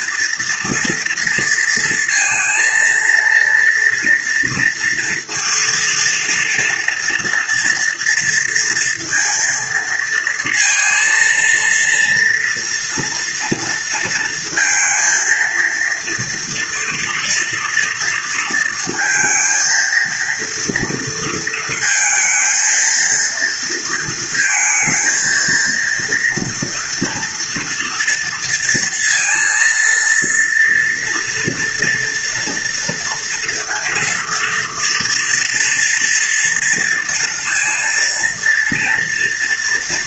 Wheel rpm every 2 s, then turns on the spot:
230, 230, 230, 230, 230, 230, 240, 230, 230, 230, 230, 230, 230, 230, 230, 230, 230, 230, 240, 230.
none